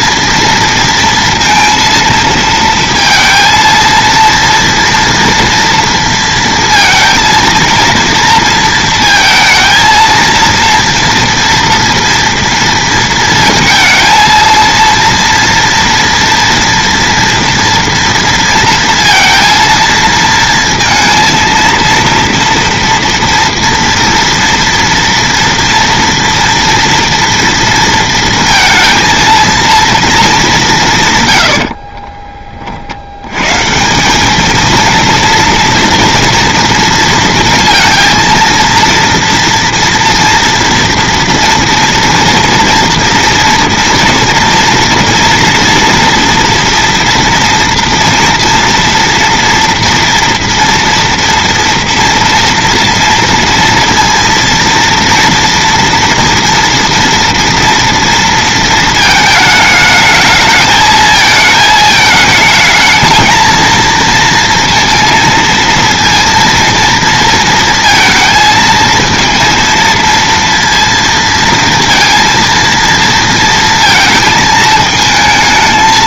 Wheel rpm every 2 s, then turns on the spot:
230, 230, 230, 230, 230, 230, 230, 230, 240, 230, 230, 230, 230, 230, 220, 210, 40, 220, 230, 230, 230, 230, 240, 240, 230, 230, 230, 230, 230, 230, 220, 220, 230, 230, 230, 230, 230, 220.
none